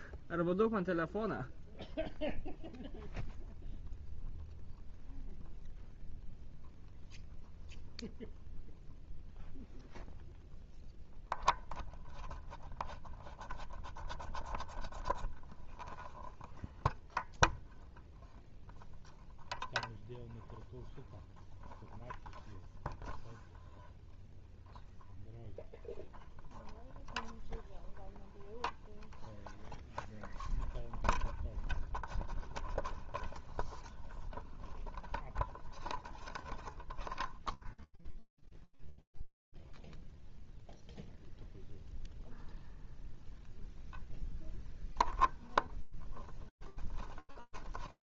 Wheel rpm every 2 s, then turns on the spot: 0, 0, 0, 0, 0, 0, 0, 0, 0, 0, 0, 0, 0, 0, 0, 0, 0, 0, 0, 0, 0, 0, 0, 0.
none